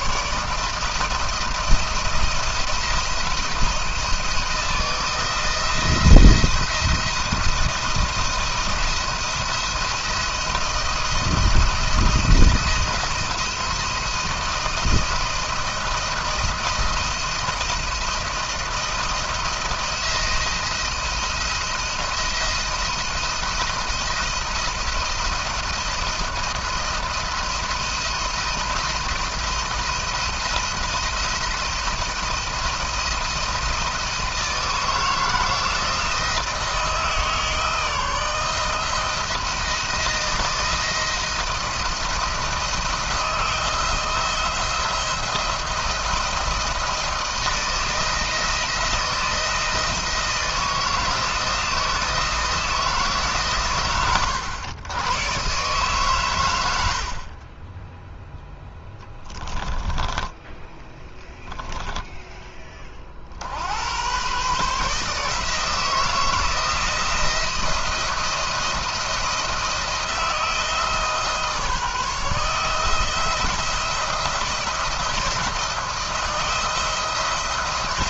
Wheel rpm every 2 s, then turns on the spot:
150, 170, 160, 170, 170, 170, 170, 170, 170, 170, 170, 170, 170, 170, 170, 170, 170, 160, 160, 160, 160, 170, 170, 170, 160, 170, 160, 100, 100, 10, 10, 20, 140, 170, 170, 160, 160, 170, 160.
56-62